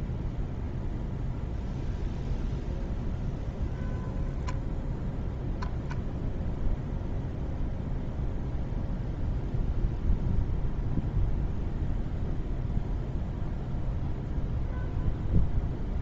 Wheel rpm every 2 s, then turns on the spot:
0, 0, 0, 0, 0, 0, 0, 0.
none